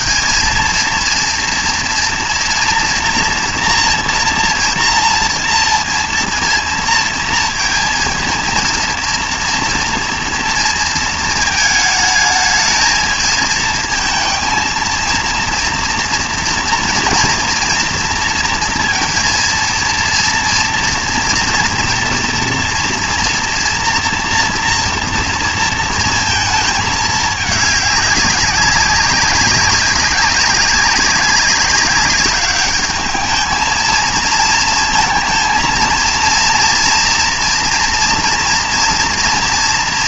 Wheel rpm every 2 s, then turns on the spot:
230, 230, 230, 230, 230, 230, 220, 220, 230, 230, 230, 230, 230, 220, 190, 190, 200, 230, 230, 230.
none